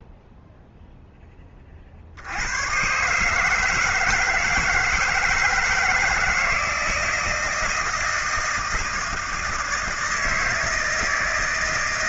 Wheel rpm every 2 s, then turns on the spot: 0, 110, 170, 160, 160, 160.
none